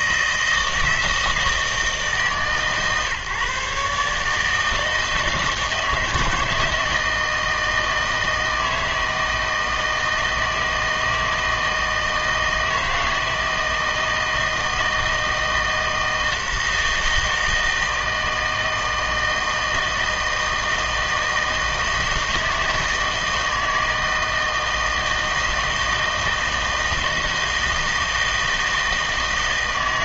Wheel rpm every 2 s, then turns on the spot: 160, 140, 160, 160, 160, 160, 160, 160, 160, 160, 160, 160, 160, 160, 160.
none